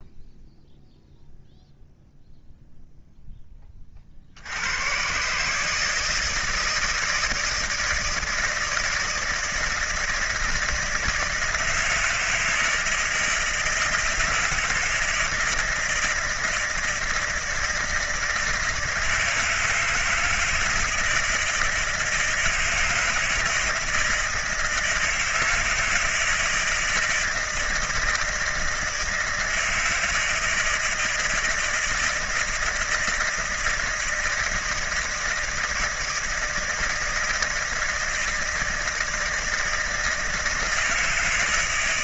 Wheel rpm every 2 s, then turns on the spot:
0, 0, 80, 160, 160, 160, 160, 160, 160, 160, 160, 160, 160, 160, 160, 160, 160, 160, 160, 160, 160.
none